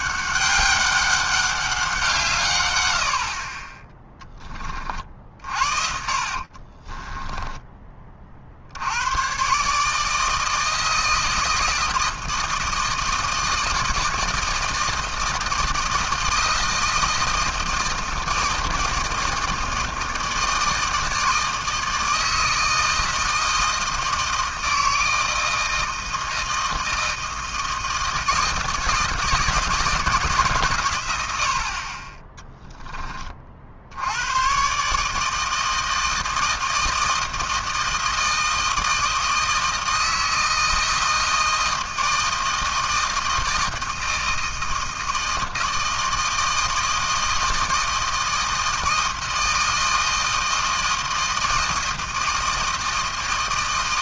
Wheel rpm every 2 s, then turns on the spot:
200, 130, 20, 40, 70, 160, 160, 160, 160, 160, 160, 160, 160, 160, 160, 140, 10, 120, 160, 160, 160, 160, 160, 160, 160, 160, 160.
6-8 32-34